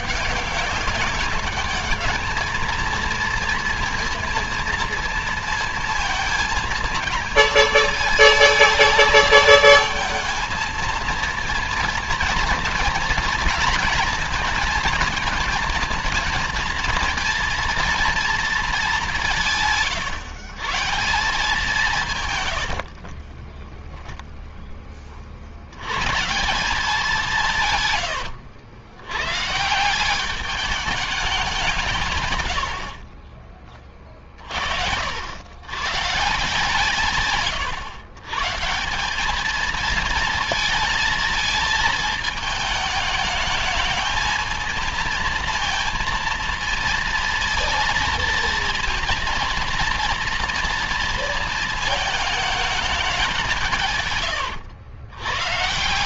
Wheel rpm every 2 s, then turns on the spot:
190, 220, 230, 230, 220, 220, 230, 220, 230, 220, 150, 120, 10, 160, 100, 200, 110, 50, 150, 150, 230, 210, 220, 230, 230, 230, 220, 110.
22-24 32-34